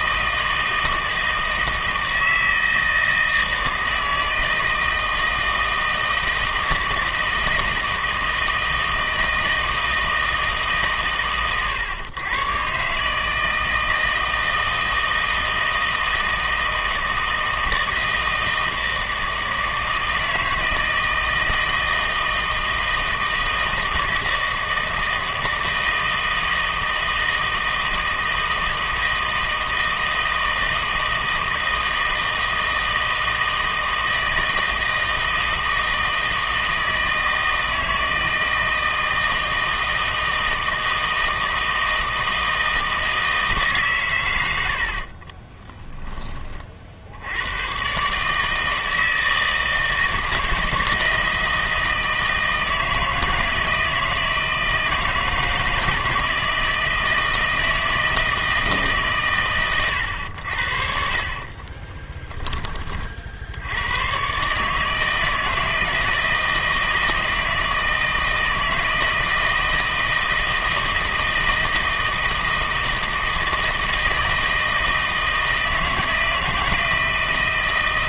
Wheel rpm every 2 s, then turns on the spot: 160, 160, 160, 160, 160, 150, 140, 160, 160, 160, 160, 160, 160, 160, 160, 160, 160, 160, 160, 160, 160, 160, 90, 40, 160, 160, 160, 160, 160, 150, 70, 20, 150, 160, 160, 160, 160, 160, 160.
44-46